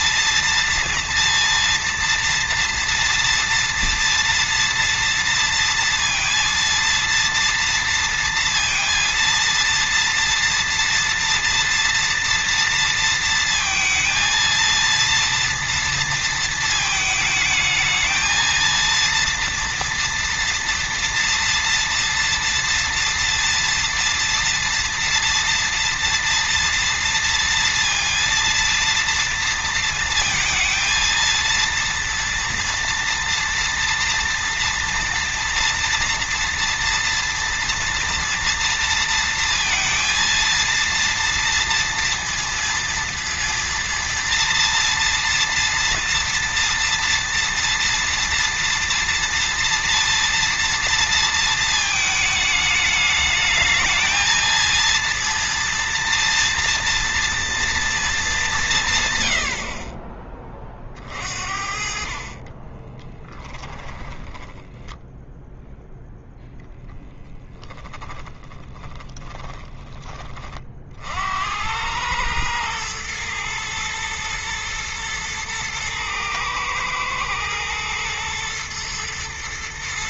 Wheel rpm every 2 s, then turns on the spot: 230, 240, 230, 230, 230, 230, 230, 230, 220, 230, 230, 230, 230, 230, 230, 230, 230, 230, 230, 230, 230, 230, 230, 230, 230, 230, 210, 230, 230, 150, 40, 20, 20, 0, 10, 60, 110, 110, 110, 110.
62-66 68-70